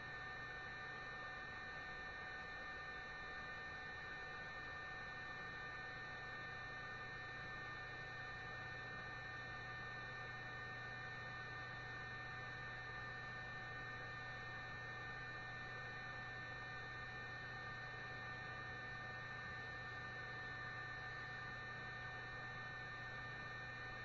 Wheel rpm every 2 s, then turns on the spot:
0, 0, 0, 0, 0, 0, 0, 0, 0, 0, 0, 0.
none